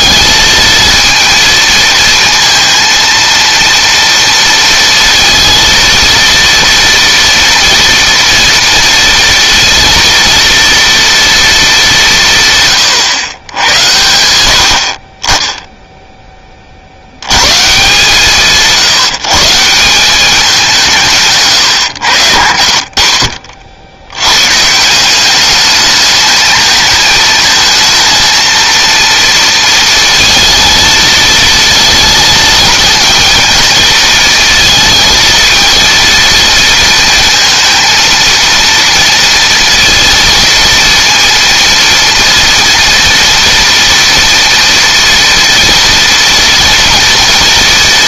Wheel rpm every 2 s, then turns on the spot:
230, 230, 230, 230, 230, 230, 110, 40, 80, 150, 160, 70, 170, 220, 230, 220, 220, 230, 230, 230, 230, 230, 230, 230.
none